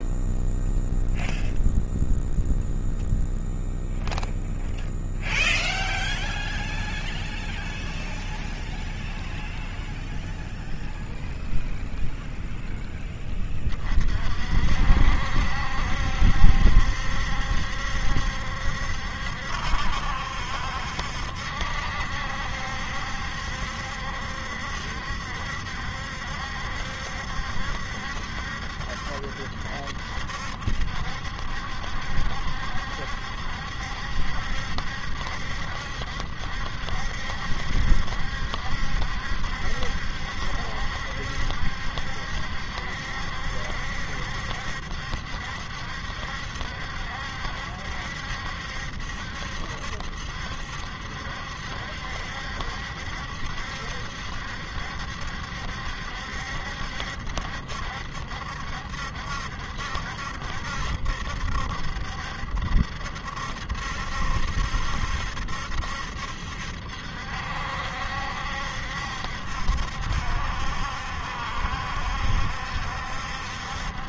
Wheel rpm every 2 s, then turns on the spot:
0, 0, 0, 0, 0, 0, 0, 50, 70, 70, 70, 70, 70, 70, 70, 70, 70, 70, 70, 70, 70, 70, 70, 70, 70, 70, 70, 70, 70, 70, 70, 70, 70, 70, 70, 70, 70.
none